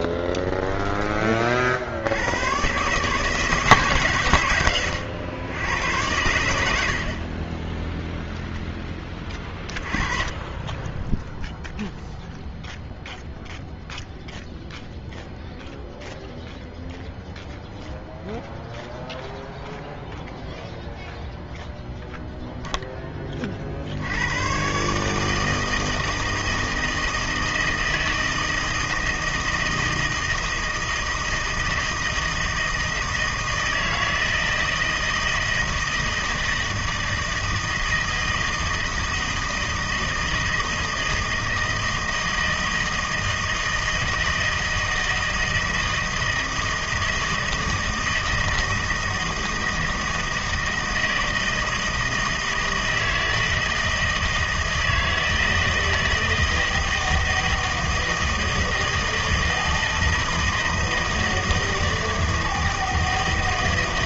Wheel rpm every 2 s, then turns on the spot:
10, 120, 130, 80, 10, 20, 0, 0, 0, 0, 0, 0, 130, 160, 160, 160, 160, 160, 160, 160, 160, 160, 160, 160, 160, 160, 160, 160, 160, 160, 160, 160.
0-2